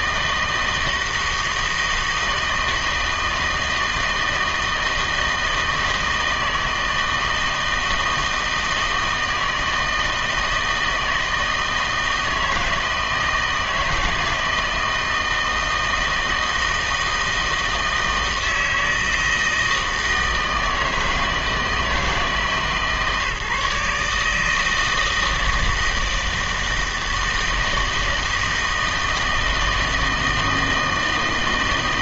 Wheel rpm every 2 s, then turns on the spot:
160, 160, 160, 160, 160, 160, 160, 160, 160, 160, 160, 150, 160, 160, 160, 160.
none